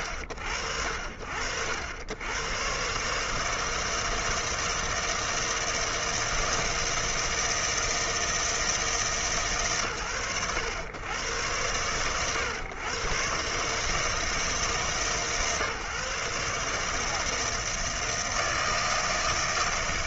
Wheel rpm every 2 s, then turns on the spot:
90, 160, 160, 160, 90, 110, 160, 150, 160, 160.
none